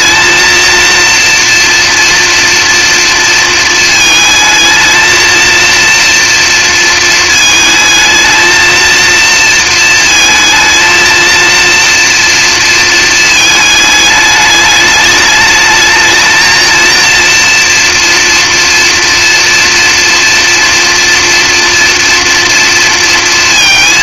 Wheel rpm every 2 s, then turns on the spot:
230, 230, 220, 230, 220, 220, 230, 210, 230, 230, 230, 230.
none